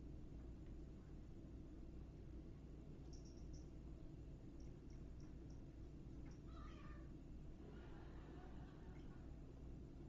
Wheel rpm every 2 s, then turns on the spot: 0, 0, 0, 0, 0.
none